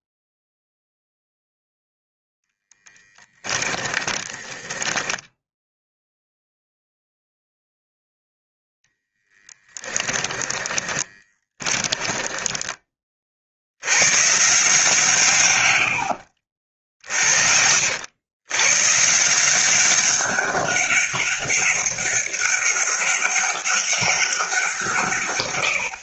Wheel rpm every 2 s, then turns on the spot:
0, 10, 20, 0, 10, 20, 20, 140, 50, 130, 200, 200, 160.
2-6 8-12 16-18